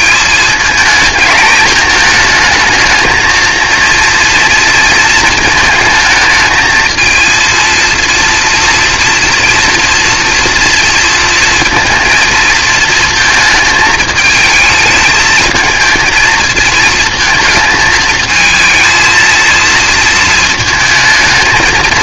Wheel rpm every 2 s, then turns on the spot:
220, 220, 230, 220, 240, 230, 230, 220, 220, 220, 220.
none